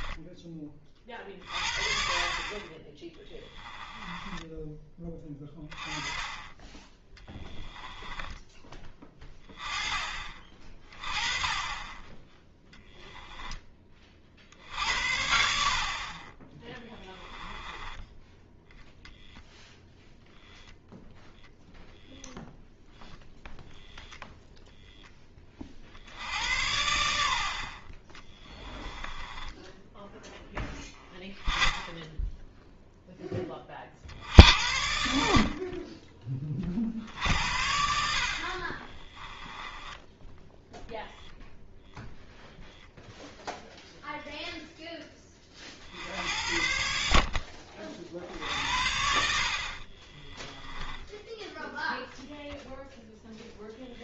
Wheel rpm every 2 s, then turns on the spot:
30, 20, 20, 10, 20, 30, 0, 60, 10, 0, 0, 0, 0, 80, 10, 0, 0, 70, 50, 30, 0, 0, 10, 70, 70, 10, 0.
16-18 28-30 38-40